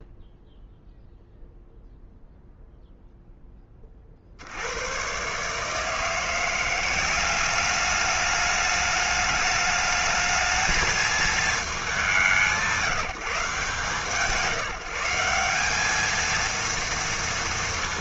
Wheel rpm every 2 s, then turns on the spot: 0, 0, 100, 190, 210, 220, 170, 170, 230.
none